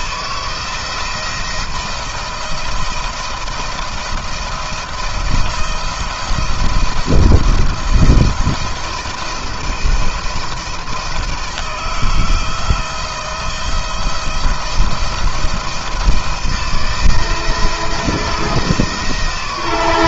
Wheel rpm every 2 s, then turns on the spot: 170, 170, 170, 170, 170, 170, 160, 170, 160, 160.
none